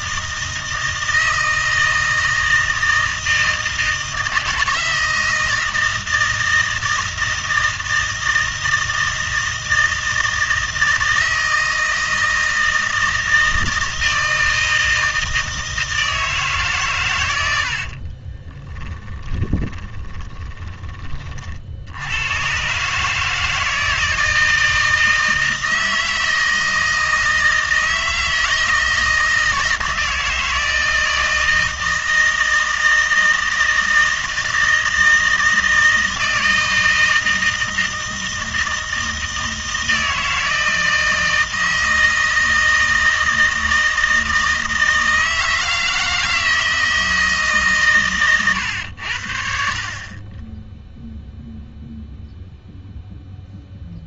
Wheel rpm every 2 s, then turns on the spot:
160, 160, 160, 160, 160, 160, 160, 160, 80, 20, 50, 150, 160, 160, 160, 160, 160, 160, 160, 160, 160, 160, 160, 150, 50, 0, 0.
18-20